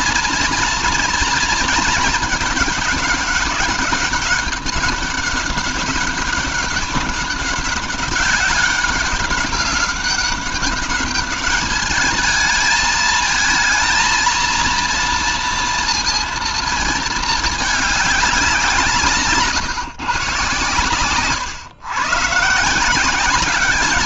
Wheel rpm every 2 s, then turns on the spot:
230, 210, 200, 200, 190, 200, 210, 230, 230, 170, 120, 160.
none